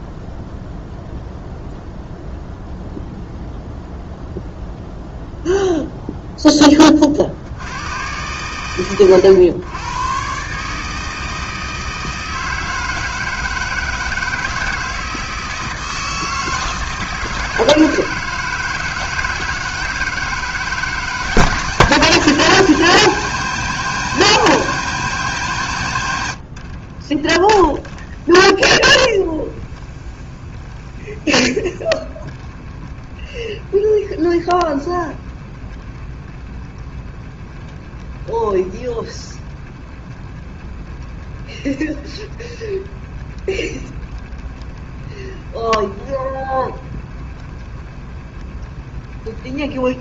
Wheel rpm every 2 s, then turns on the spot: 0, 0, 0, 20, 110, 150, 160, 160, 160, 160, 160, 170, 170, 40, 20, 20, 20, 40, 20, 20, 20, 20, 20, 20, 20.
26-50